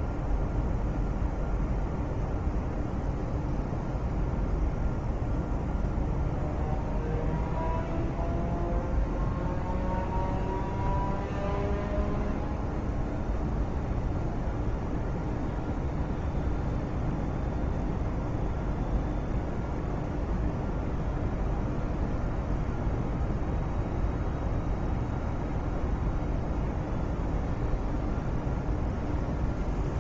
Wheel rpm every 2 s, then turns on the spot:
0, 0, 0, 0, 0, 0, 0, 0, 0, 0, 0, 0, 0, 0, 0.
none